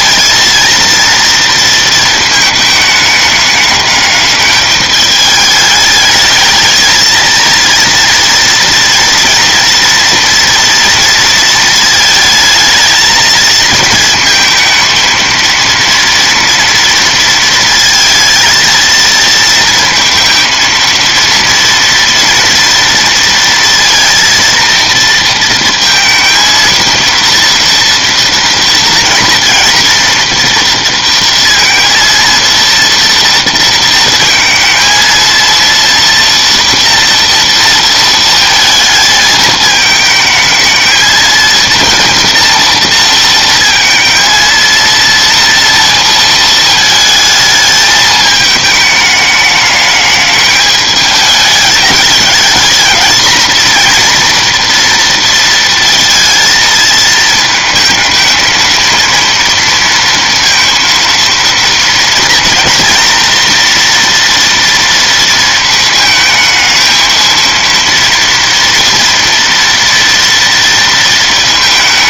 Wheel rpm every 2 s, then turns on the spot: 230, 220, 210, 220, 230, 230, 220, 220, 230, 230, 230, 230, 230, 230, 230, 230, 230, 230, 240, 220, 220, 230, 230, 220, 210, 210, 220, 240, 230, 220, 230, 230, 230, 220, 230, 230.
none